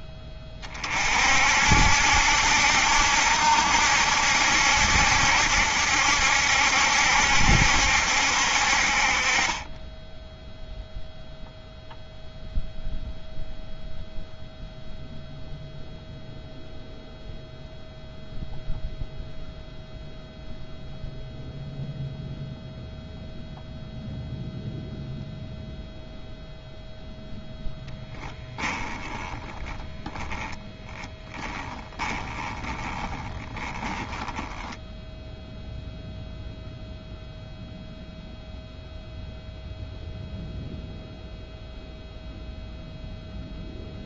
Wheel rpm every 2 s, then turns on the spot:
30, 70, 70, 70, 50, 0, 0, 0, 0, 0, 0, 0, 0, 0, 10, 10, 10, 10, 0, 0, 0, 0.
30-36